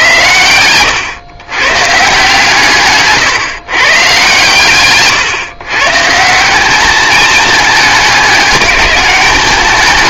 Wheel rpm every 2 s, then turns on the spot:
100, 140, 140, 180, 210.
none